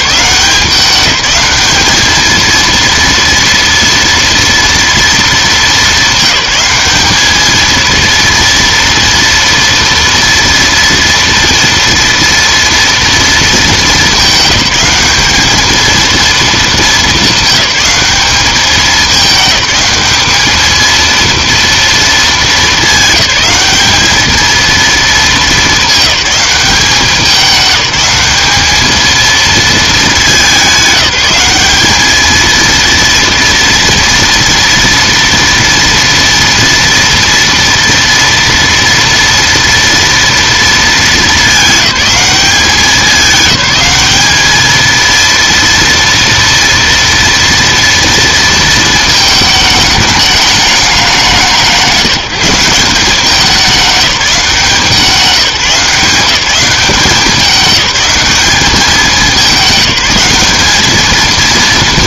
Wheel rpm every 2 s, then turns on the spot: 190, 230, 230, 210, 230, 230, 230, 200, 220, 210, 220, 220, 230, 200, 210, 210, 230, 230, 230, 230, 220, 200, 220, 230, 230, 200, 180, 180, 190, 210, 210.
none